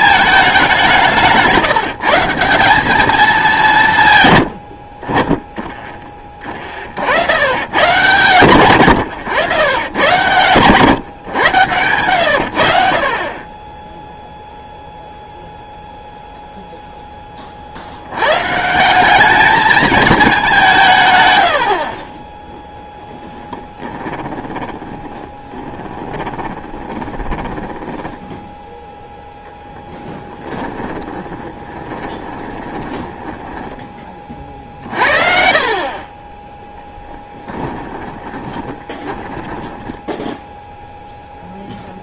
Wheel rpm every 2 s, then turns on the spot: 200, 200, 70, 40, 90, 110, 60, 0, 0, 170, 180, 0, 10, 20, 0, 20, 20, 40, 10, 30, 0.
24-28 30-40